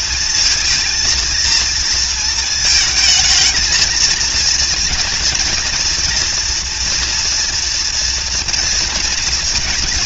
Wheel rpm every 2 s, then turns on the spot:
220, 230, 230, 240, 240.
none